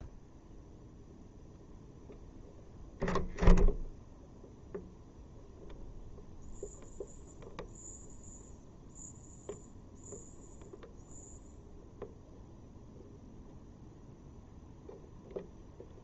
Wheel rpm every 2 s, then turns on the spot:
0, 0, 0, 0, 0, 0, 0, 0.
none